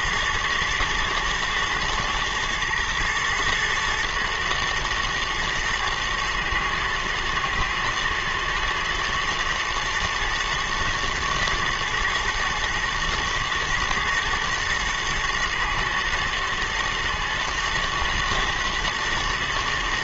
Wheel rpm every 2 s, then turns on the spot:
110, 110, 120, 110, 110, 110, 110, 120, 110, 110.
none